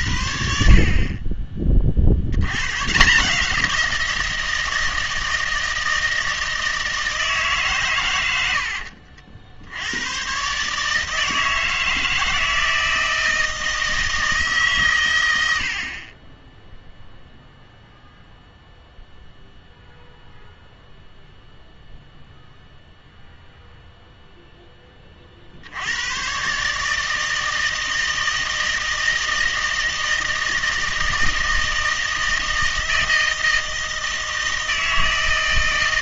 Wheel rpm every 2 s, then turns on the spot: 50, 120, 160, 160, 70, 150, 160, 120, 0, 0, 0, 0, 10, 150, 160, 160, 160, 160.
8-10